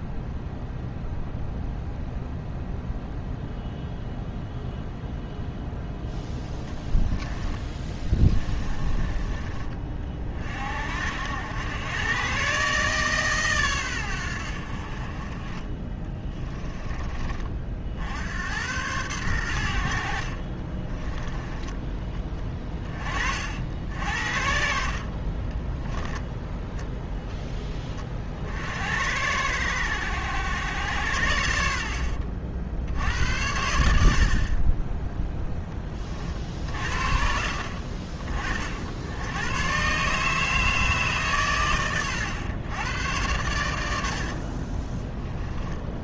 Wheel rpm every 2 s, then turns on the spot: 0, 0, 0, 10, 30, 70, 140, 60, 20, 100, 30, 30, 50, 0, 60, 90, 60, 20, 50, 60, 150, 110, 20.
6-10 20-22 44-46